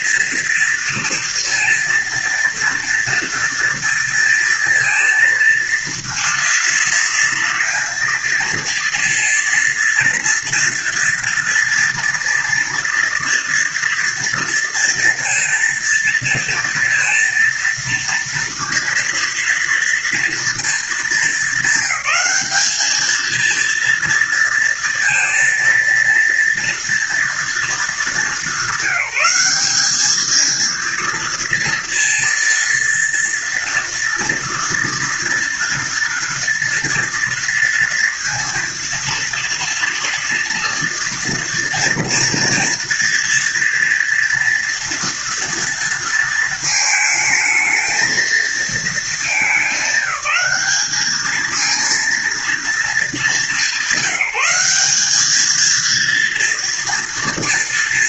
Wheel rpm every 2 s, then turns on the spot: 230, 230, 230, 230, 230, 230, 230, 230, 230, 230, 210, 220, 230, 230, 200, 230, 230, 230, 230, 230, 230, 230, 230, 220, 210, 210, 210, 200, 230.
none